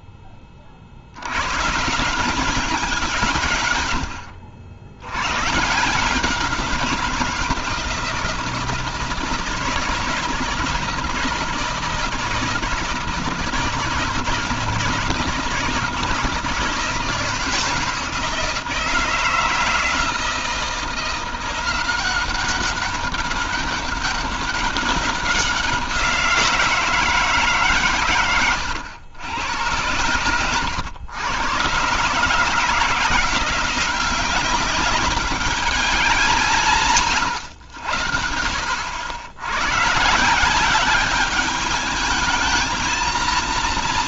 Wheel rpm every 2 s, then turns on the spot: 50, 180, 90, 180, 160, 160, 160, 160, 160, 160, 170, 190, 200, 170, 100, 110, 160, 200, 170, 60, 190, 230.
none